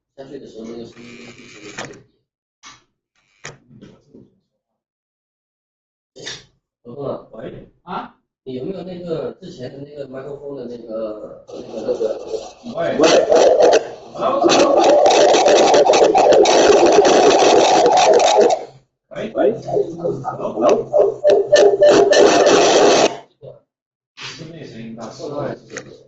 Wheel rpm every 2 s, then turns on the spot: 10, 0, 0, 0, 0, 0, 0, 0, 0, 0, 0, 0, 0.
none